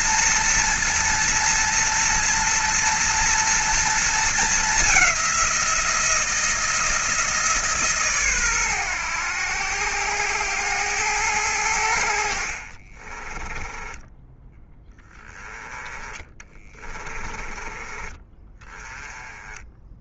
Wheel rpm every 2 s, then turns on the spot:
230, 230, 190, 160, 100, 100, 30, 20, 20, 10.
12-14 16-18